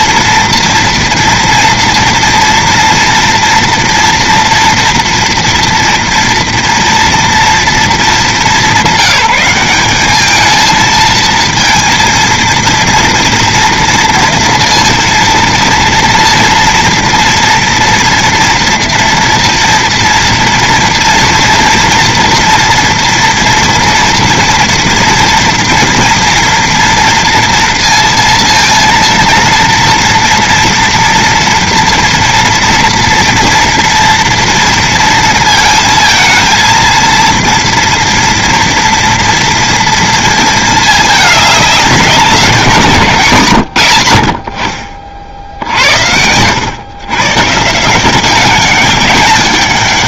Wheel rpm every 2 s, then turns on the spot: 230, 240, 230, 230, 200, 220, 230, 230, 230, 240, 230, 240, 230, 230, 230, 230, 230, 230, 230, 240, 220, 180, 50, 110, 190.
none